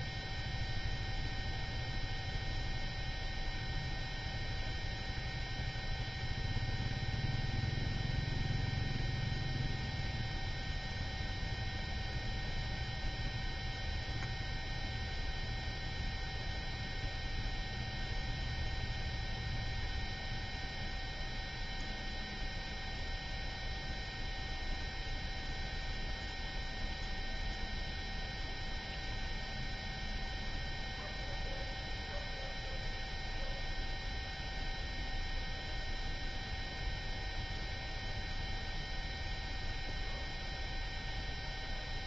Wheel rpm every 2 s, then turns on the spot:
0, 0, 0, 0, 0, 0, 0, 0, 0, 0, 0, 0, 0, 0, 0, 0, 0, 0, 0, 0, 0.
none